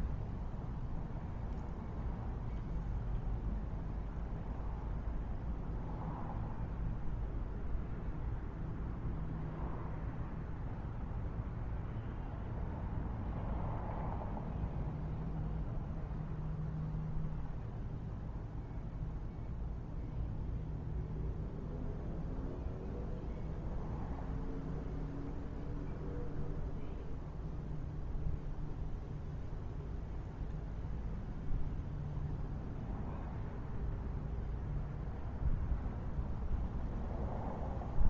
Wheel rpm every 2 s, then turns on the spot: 0, 0, 0, 0, 0, 0, 0, 0, 0, 0, 0, 0, 0, 0, 0, 0, 0, 0, 0.
none